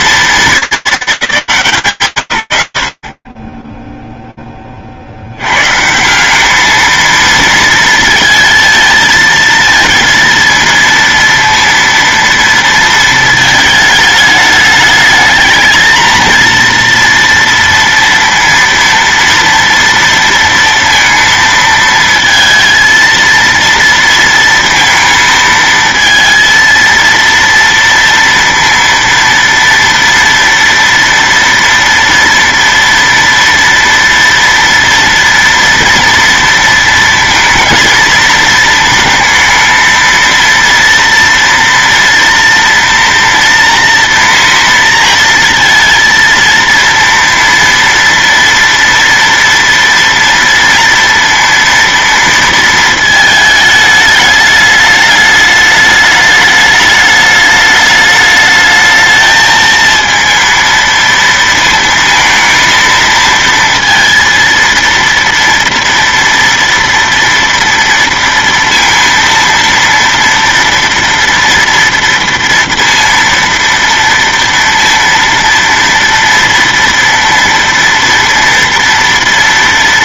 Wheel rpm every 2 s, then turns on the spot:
200, 60, 60, 220, 220, 230, 220, 210, 230, 230, 230, 230, 230, 230, 230, 230, 230, 240, 230, 230, 230, 230, 230, 230, 230, 230, 220, 210, 210, 220, 230, 230, 230, 230, 230, 240, 230, 230, 230, 230.
none